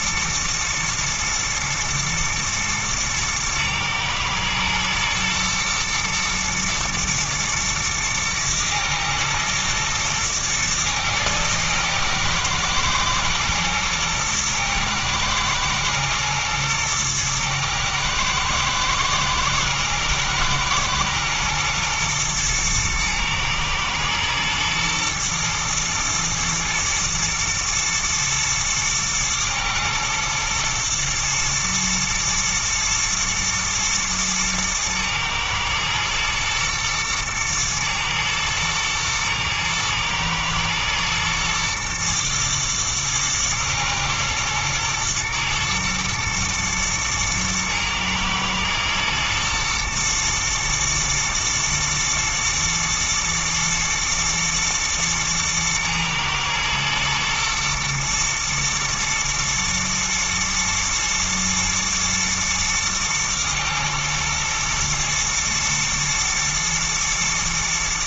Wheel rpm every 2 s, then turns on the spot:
110, 110, 110, 110, 120, 110, 110, 110, 110, 110, 110, 110, 120, 110, 110, 120, 110, 110, 110, 110, 120, 110, 120, 110, 110, 110, 120, 110, 110, 120, 120, 120, 120, 120.
none